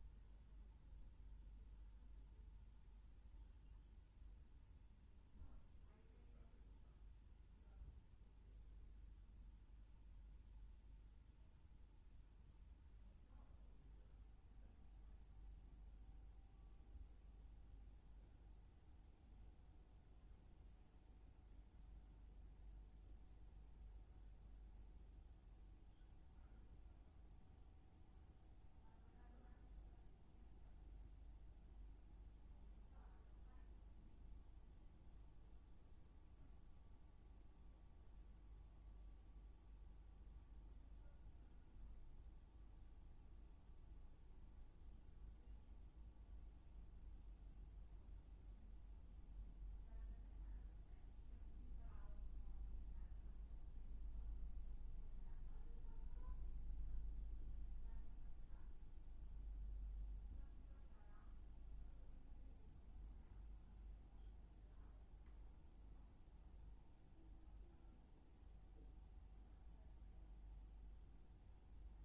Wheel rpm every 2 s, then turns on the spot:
0, 0, 0, 0, 0, 0, 0, 0, 0, 0, 0, 0, 0, 0, 0, 0, 0, 0, 0, 0, 0, 0, 0, 0, 0, 0, 0, 0, 0, 0, 0, 0, 0, 0, 0, 0.
none